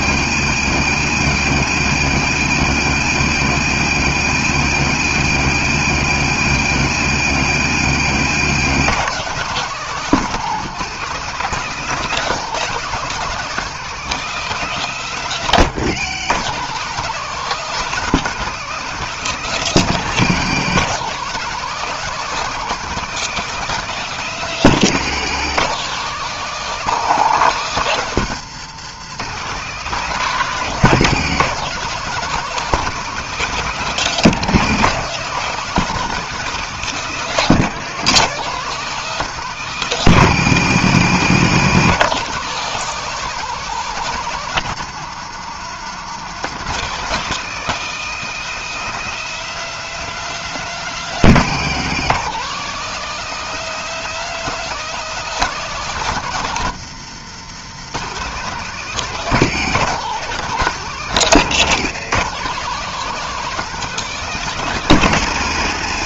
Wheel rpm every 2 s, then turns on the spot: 140, 150, 150, 150, 160, 180, 200, 200, 170, 200, 180, 200, 180, 190, 160, 190, 200, 190, 190, 190, 170, 190, 170, 180, 210, 200, 180, 210, 160, 170, 180, 180, 190.
none